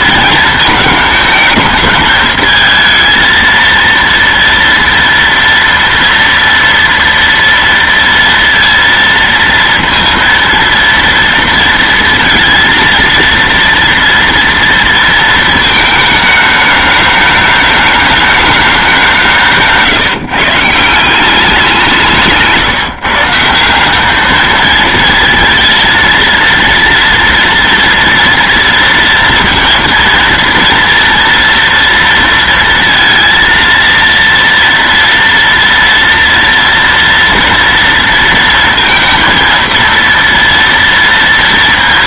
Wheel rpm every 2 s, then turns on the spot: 230, 220, 230, 230, 230, 230, 230, 230, 210, 210, 150, 160, 200, 230, 230, 230, 230, 230, 230, 230, 230.
none